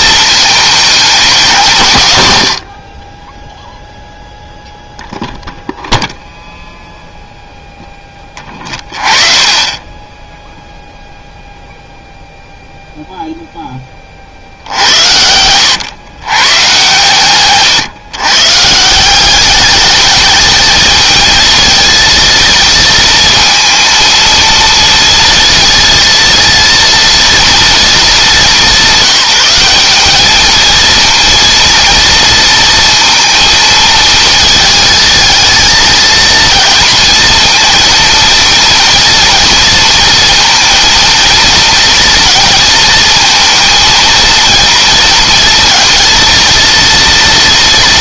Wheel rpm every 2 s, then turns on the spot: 210, 60, 0, 0, 30, 0, 0, 70, 120, 160, 220, 230, 230, 230, 190, 220, 230, 220, 230, 230, 230, 230, 230, 230.
14-16